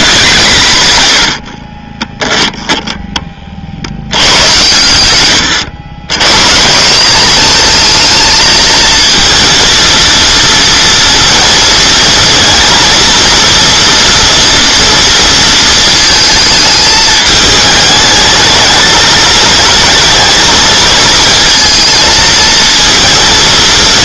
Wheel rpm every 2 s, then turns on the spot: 130, 10, 100, 170, 230, 230, 230, 230, 220, 220, 230, 220.
2-4